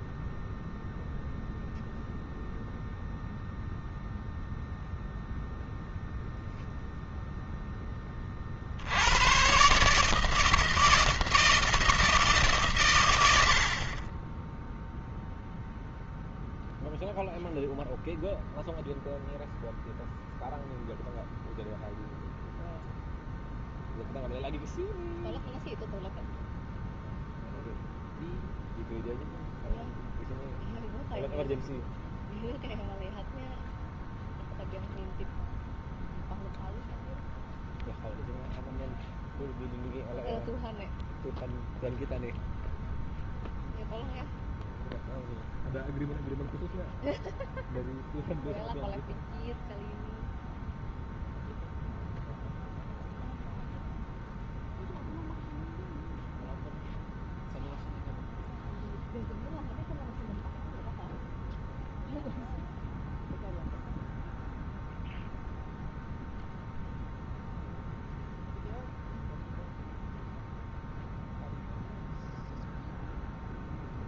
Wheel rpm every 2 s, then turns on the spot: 0, 0, 0, 0, 80, 160, 120, 0, 0, 0, 0, 0, 0, 0, 0, 0, 0, 0, 0, 0, 0, 0, 0, 0, 0, 0, 0, 0, 0, 0, 0, 0, 0, 0, 0, 0, 0.
none